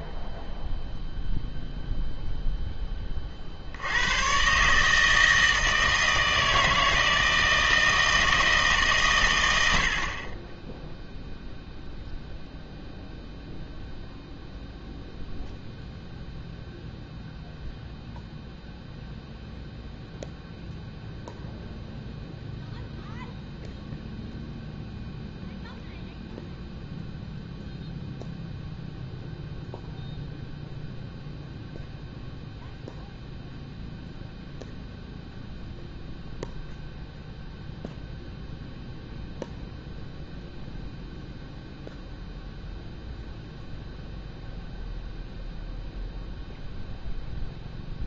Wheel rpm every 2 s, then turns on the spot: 0, 10, 140, 160, 160, 20, 0, 0, 0, 0, 0, 0, 0, 0, 0, 0, 0, 0, 0, 0, 0, 0, 0, 0.
none